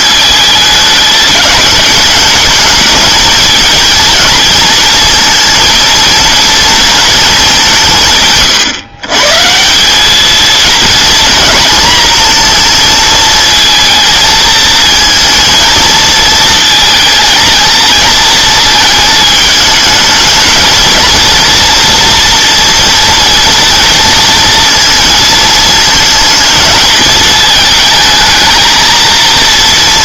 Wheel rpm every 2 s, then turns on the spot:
210, 220, 230, 230, 140, 210, 230, 220, 230, 230, 220, 230, 230, 230, 220.
none